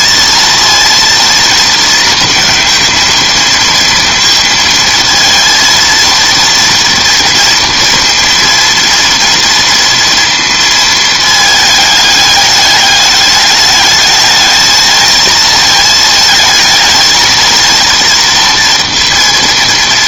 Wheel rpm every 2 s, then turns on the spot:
230, 220, 230, 230, 230, 220, 210, 220, 220, 230.
none